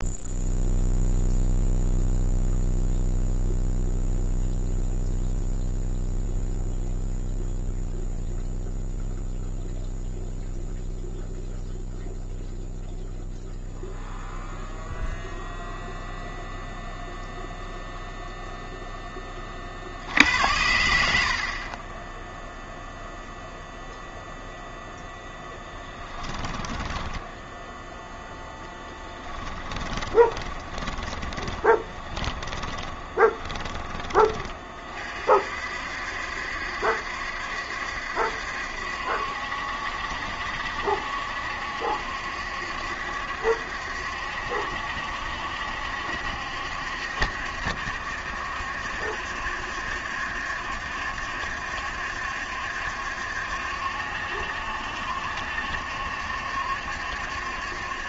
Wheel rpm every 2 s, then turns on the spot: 0, 0, 0, 0, 0, 0, 0, 0, 0, 0, 90, 0, 0, 10, 10, 20, 20, 20, 70, 70, 70, 70, 70, 70, 70, 70, 70, 70, 70.
26-28 30-34